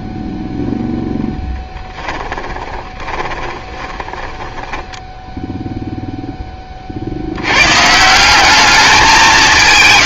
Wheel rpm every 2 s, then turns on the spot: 0, 20, 10, 30, 210.
2-6